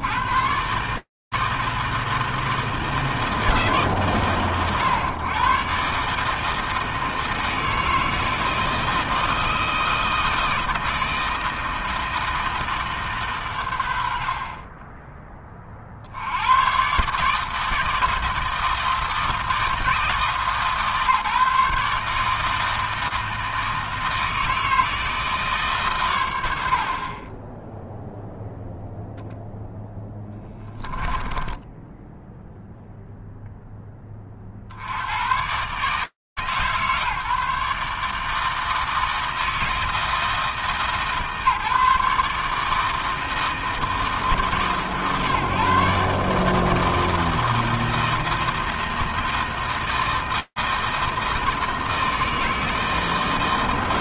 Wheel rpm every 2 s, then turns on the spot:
120, 160, 100, 160, 160, 160, 160, 60, 100, 160, 150, 160, 160, 90, 0, 10, 0, 50, 130, 160, 150, 160, 140, 160, 160, 160, 160.
30-32